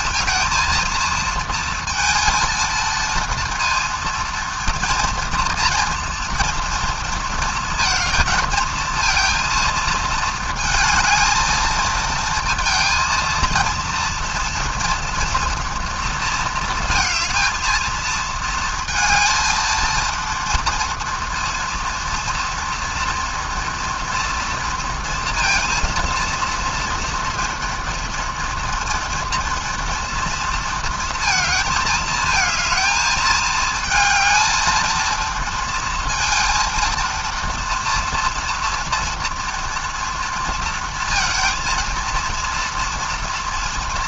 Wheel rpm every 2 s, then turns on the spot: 230, 230, 230, 230, 230, 220, 230, 230, 220, 220, 230, 230, 230, 230, 230, 230, 220, 220, 230, 230, 230, 230.
none